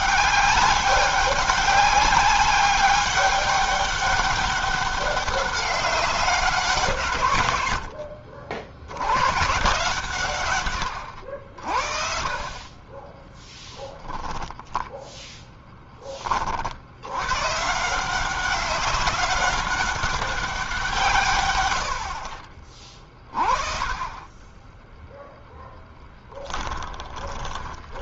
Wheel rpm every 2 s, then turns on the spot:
200, 190, 190, 190, 70, 130, 40, 10, 30, 180, 190, 50, 20, 20.
26-28